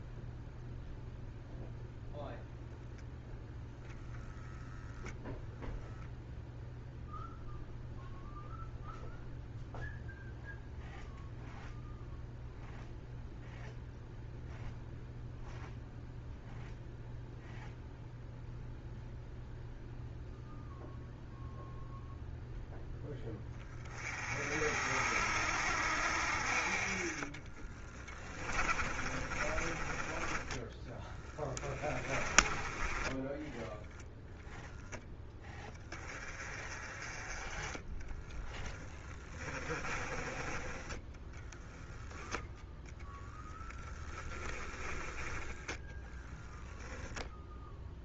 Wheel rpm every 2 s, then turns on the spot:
0, 0, 0, 0, 0, 0, 0, 0, 0, 0, 0, 10, 60, 50, 30, 10, 20, 20, 40, 20, 10, 10, 20, 0.
26-32 38-40